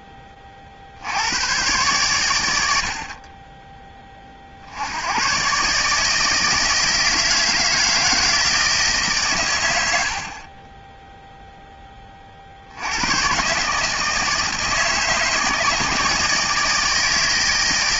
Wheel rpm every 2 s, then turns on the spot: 60, 70, 70, 160, 160, 20, 90, 160, 150.
none